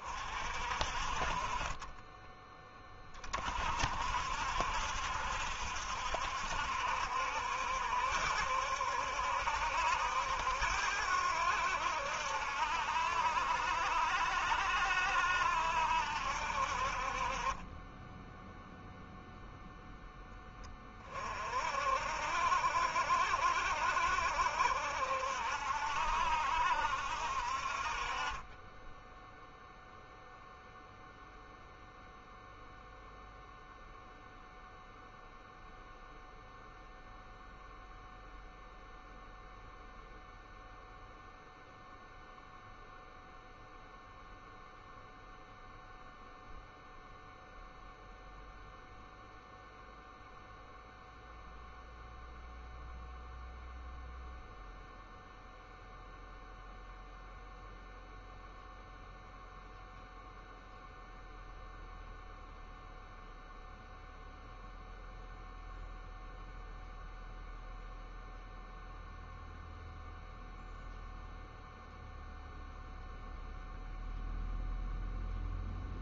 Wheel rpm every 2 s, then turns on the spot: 40, 20, 60, 70, 70, 80, 70, 70, 50, 0, 20, 60, 60, 60, 10, 0, 0, 0, 0, 0, 0, 0, 0, 0, 0, 0, 0, 0, 0, 0, 0, 0, 0, 0, 0, 0, 0, 0.
none